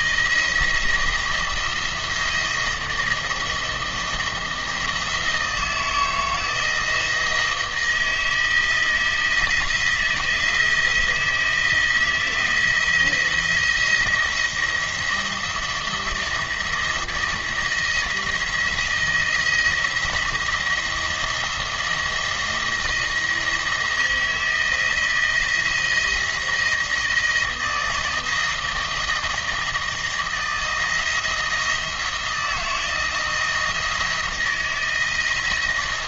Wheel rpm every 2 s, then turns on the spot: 170, 170, 170, 160, 160, 170, 170, 170, 170, 160, 170, 170, 160, 160, 160, 160, 170, 170.
none